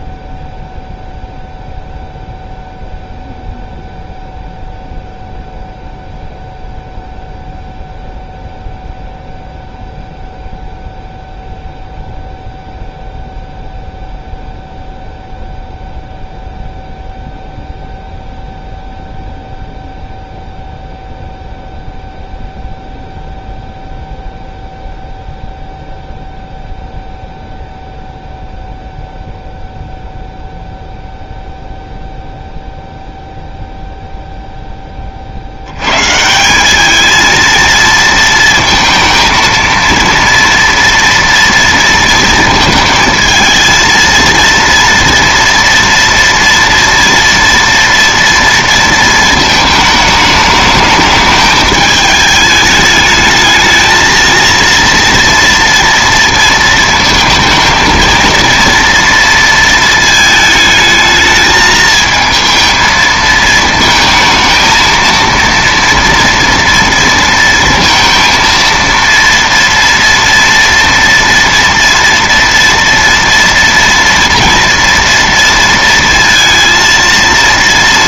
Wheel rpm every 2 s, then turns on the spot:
0, 0, 0, 0, 0, 0, 0, 0, 0, 0, 0, 0, 0, 0, 0, 0, 0, 0, 180, 230, 230, 230, 230, 230, 230, 210, 210, 230, 230, 230, 220, 220, 220, 230, 230, 230, 230, 230, 230.
none